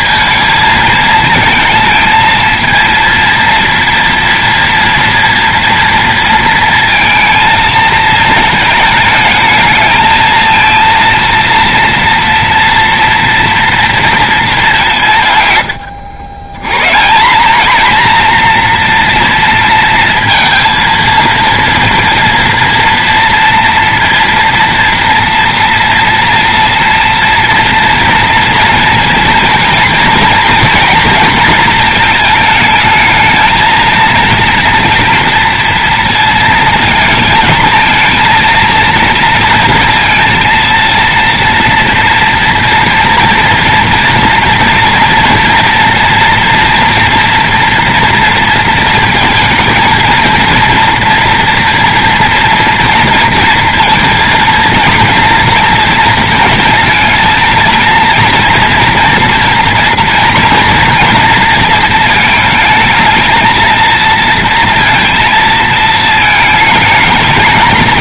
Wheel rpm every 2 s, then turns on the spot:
220, 230, 240, 230, 220, 230, 230, 210, 140, 240, 230, 230, 230, 230, 230, 230, 220, 230, 230, 230, 230, 240, 240, 230, 230, 230, 230, 230, 230, 240, 230, 220, 230, 220.
none